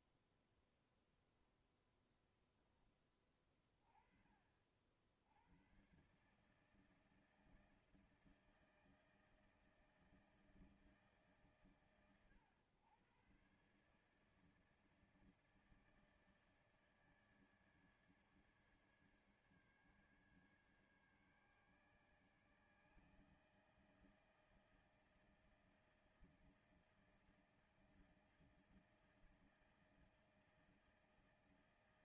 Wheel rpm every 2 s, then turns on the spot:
10, 0, 40, 130, 160, 160, 110, 150, 150, 150, 150, 150, 160, 160, 160, 160.
0-2